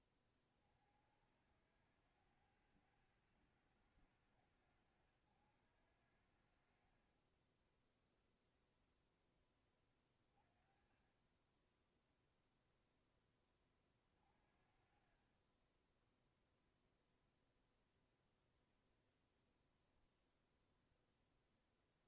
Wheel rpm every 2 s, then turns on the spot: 30, 90, 90, 60, 0, 20, 0, 40, 10, 0, 0.
16-18